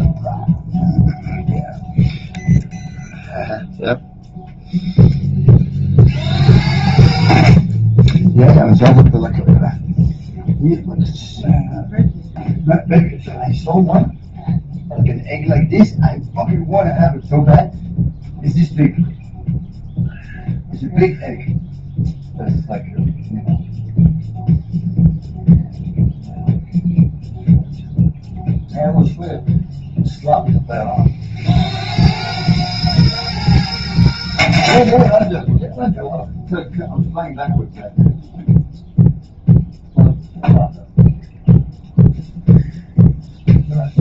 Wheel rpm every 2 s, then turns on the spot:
0, 0, 0, 0, 0, 0, 0, 0, 0, 0, 0, 0, 0, 0, 0, 0, 0, 0, 0, 0, 0, 0.
none